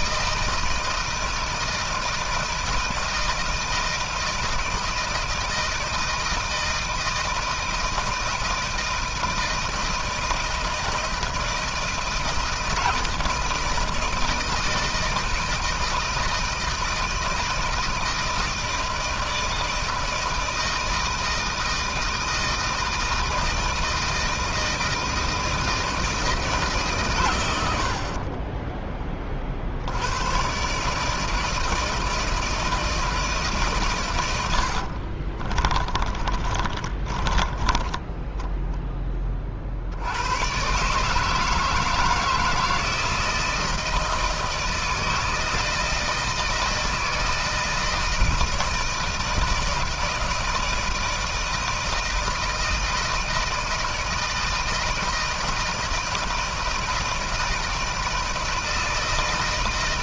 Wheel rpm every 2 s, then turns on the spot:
160, 160, 160, 160, 160, 160, 160, 160, 160, 160, 160, 160, 160, 160, 30, 110, 160, 90, 30, 10, 110, 160, 160, 160, 160, 160, 160, 160, 160, 160.
28-30 34-40